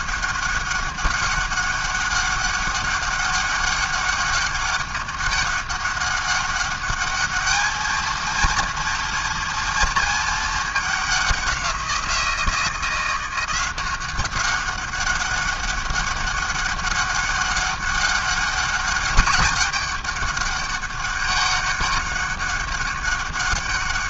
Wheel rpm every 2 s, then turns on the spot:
190, 200, 200, 200, 230, 210, 170, 200, 200, 200, 200, 200.
none